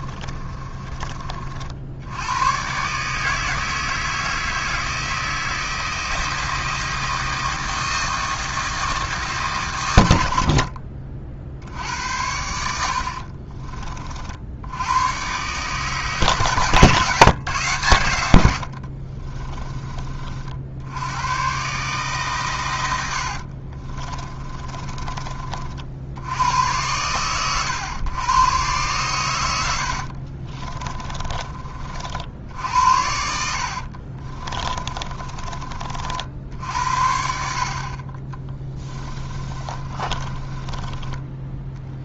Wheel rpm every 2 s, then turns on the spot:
20, 120, 160, 160, 160, 40, 80, 90, 140, 60, 70, 100, 30, 100, 120, 30, 70, 30, 70, 20, 20.
0-2 16-20 30-36 38-42